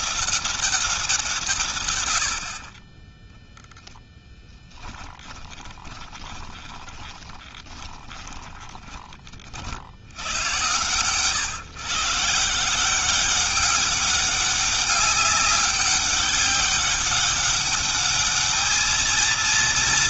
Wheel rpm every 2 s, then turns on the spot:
180, 30, 10, 20, 20, 110, 170, 200, 200, 220.
4-8